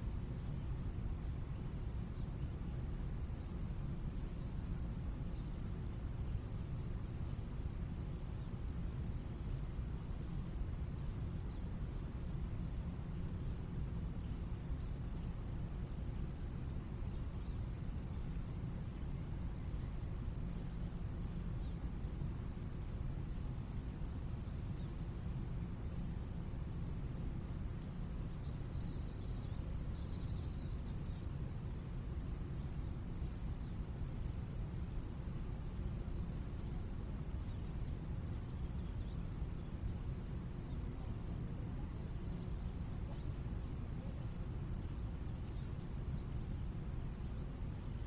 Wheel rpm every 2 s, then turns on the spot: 0, 0, 0, 0, 0, 0, 0, 0, 0, 0, 0, 0, 0, 0, 0, 0, 0, 0, 0, 0, 0, 0, 0, 0.
none